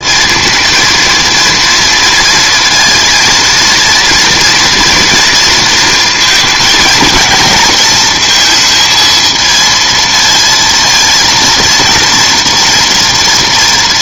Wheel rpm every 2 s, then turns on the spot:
230, 230, 230, 220, 230, 230, 230.
none